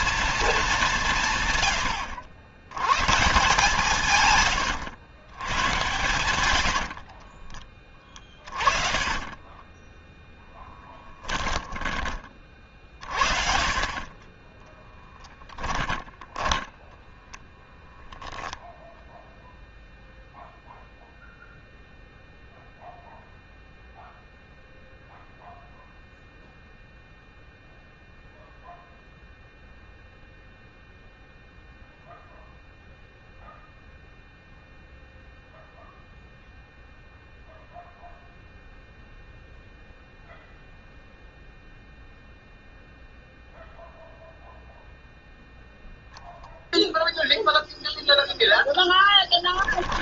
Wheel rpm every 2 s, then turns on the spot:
170, 120, 100, 60, 20, 10, 40, 10, 10, 0, 0, 0, 0, 0, 0, 0, 0, 0, 0, 0, 0, 0, 0, 0, 0.
6-12 14-18